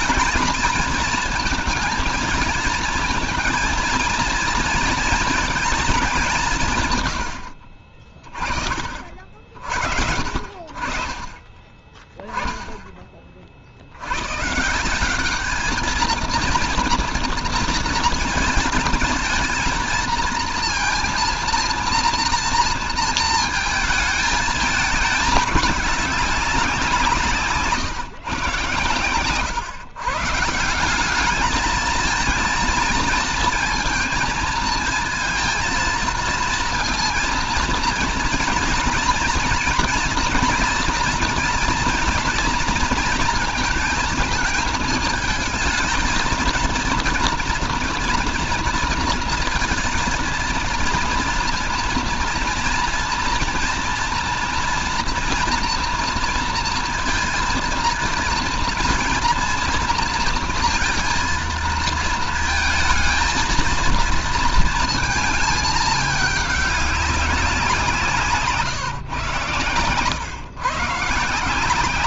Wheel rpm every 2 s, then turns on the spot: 230, 220, 230, 140, 50, 60, 10, 170, 230, 220, 230, 230, 220, 180, 130, 170, 230, 220, 230, 230, 230, 230, 220, 230, 230, 230, 230, 240, 230, 230, 230, 220, 230, 200, 140, 140.
none